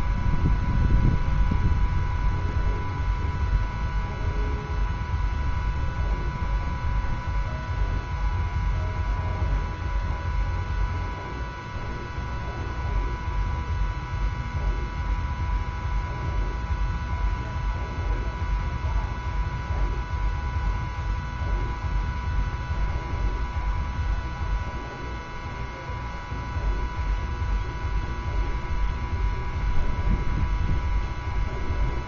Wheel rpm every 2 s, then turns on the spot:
0, 0, 0, 0, 0, 0, 0, 0, 0, 0, 0, 0, 0, 0, 0, 0.
none